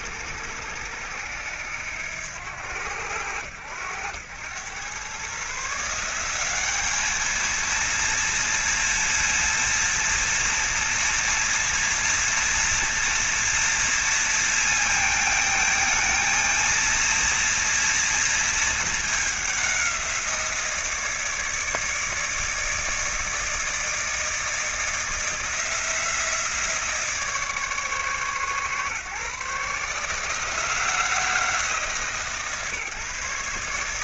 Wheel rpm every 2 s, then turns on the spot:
80, 90, 120, 210, 230, 230, 230, 220, 230, 220, 160, 160, 160, 160, 140, 170, 140.
none